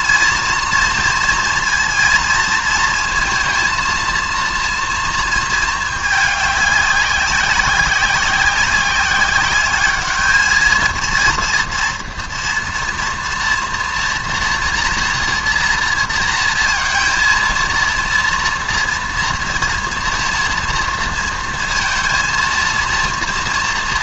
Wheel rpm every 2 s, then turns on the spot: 230, 230, 230, 190, 190, 220, 230, 230, 230, 230, 230, 230.
none